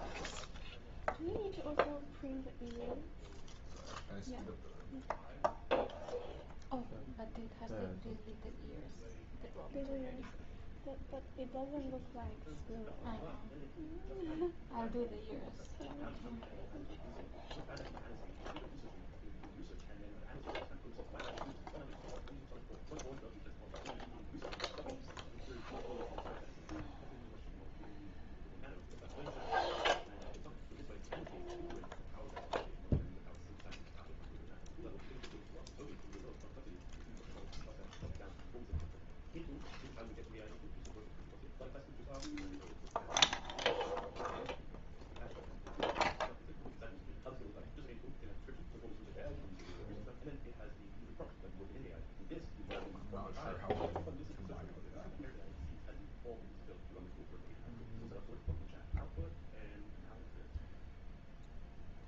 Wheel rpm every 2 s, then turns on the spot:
0, 0, 0, 0, 0, 0, 0, 0, 0, 0, 0, 0, 0, 0, 0, 0, 0, 0, 0, 0, 0, 0, 0, 0, 0, 0, 0, 0, 0, 0, 0.
none